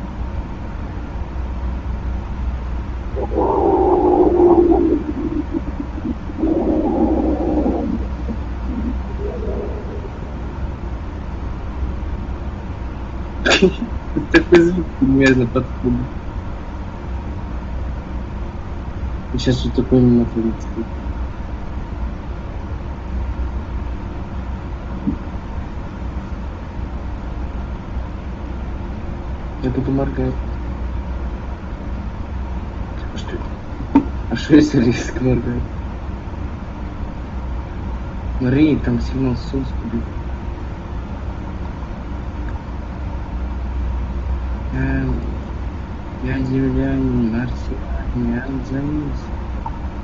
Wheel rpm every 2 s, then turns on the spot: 0, 0, 0, 0, 0, 0, 0, 0, 0, 0, 0, 0, 0, 0, 0, 0, 0, 0, 0, 0, 0, 0, 0, 0, 0.
none